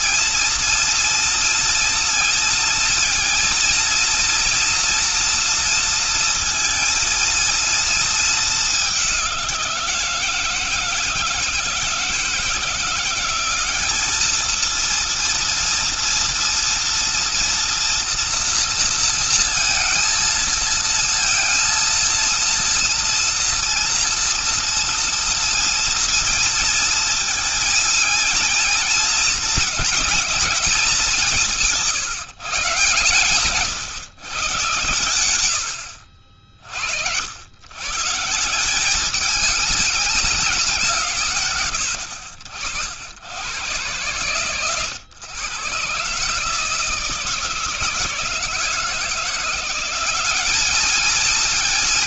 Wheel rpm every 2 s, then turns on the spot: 230, 230, 240, 230, 190, 160, 170, 230, 230, 230, 230, 230, 230, 230, 230, 190, 140, 110, 80, 200, 150, 80, 120, 160, 170, 220.
none